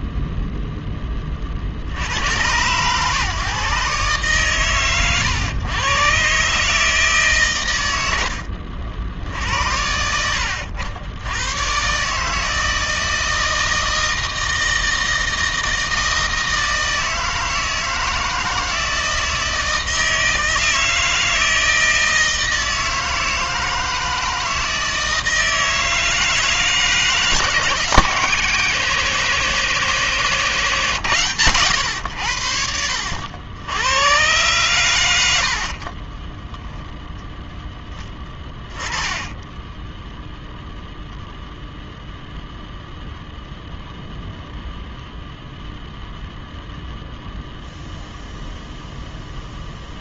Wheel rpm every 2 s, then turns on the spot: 0, 100, 130, 150, 70, 70, 160, 160, 160, 160, 160, 160, 160, 160, 150, 150, 70, 120, 10, 10, 0, 0, 0, 0, 0.
36-40